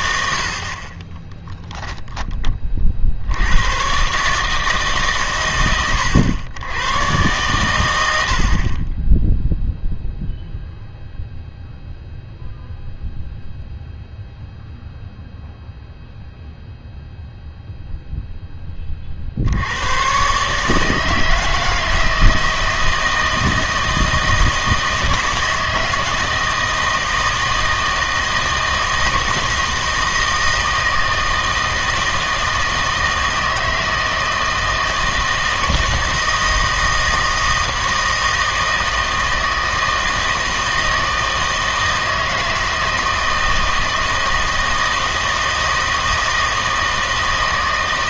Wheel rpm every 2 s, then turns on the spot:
70, 30, 150, 100, 50, 0, 0, 0, 0, 10, 150, 160, 160, 160, 160, 160, 160, 160, 160, 160, 160, 160, 160, 160.
none